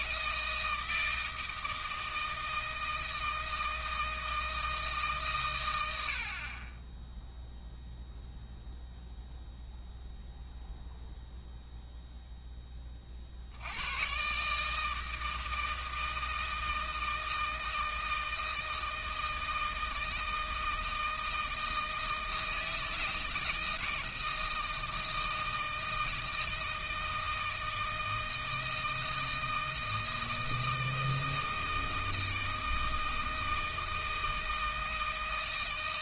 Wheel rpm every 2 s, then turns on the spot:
160, 160, 160, 20, 0, 0, 20, 150, 160, 160, 160, 160, 160, 160, 160, 160, 160, 160.
none